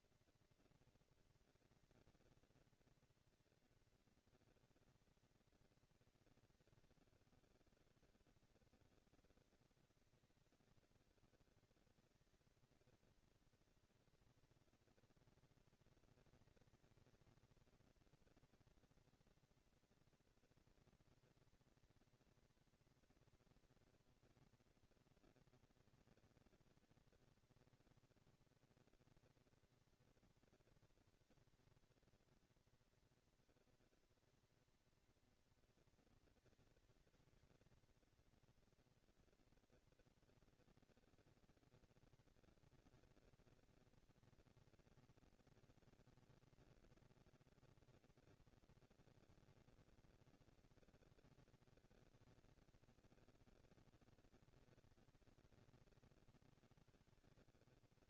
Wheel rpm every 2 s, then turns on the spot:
230, 230, 230, 220, 190, 200, 210, 230, 230, 230, 230, 230, 230, 230, 230, 230, 230, 230, 230, 230, 230, 230, 230, 230, 230, 230, 230, 200, 130.
none